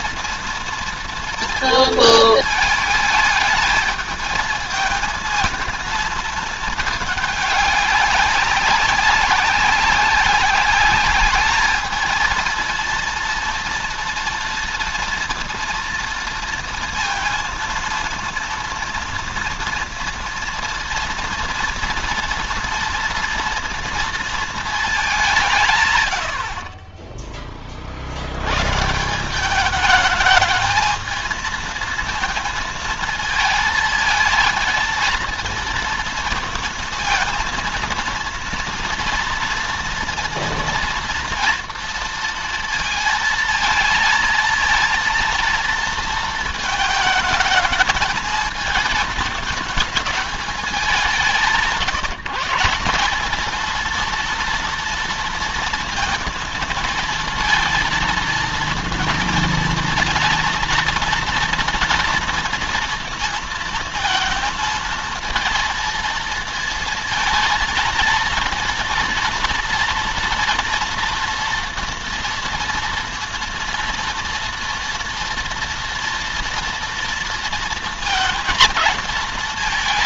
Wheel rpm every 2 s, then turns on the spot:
230, 220, 220, 210, 200, 200, 230, 230, 230, 230, 240, 230, 210, 30, 150, 220, 230, 230, 230, 230, 230, 230, 230, 220, 220, 200, 190, 230, 230, 230, 240, 230, 230, 220, 230, 230, 230, 230, 230, 220.
none